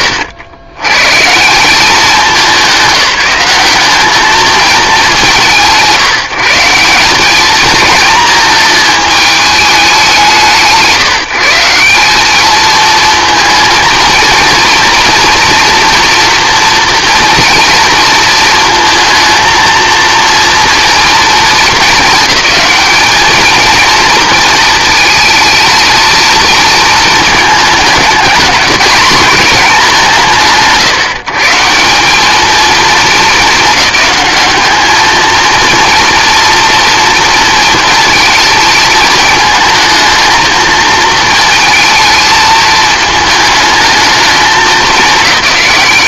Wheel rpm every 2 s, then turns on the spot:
110, 190, 190, 180, 220, 160, 230, 230, 230, 230, 230, 210, 220, 220, 210, 150, 220, 210, 230, 220, 220, 220, 210.
none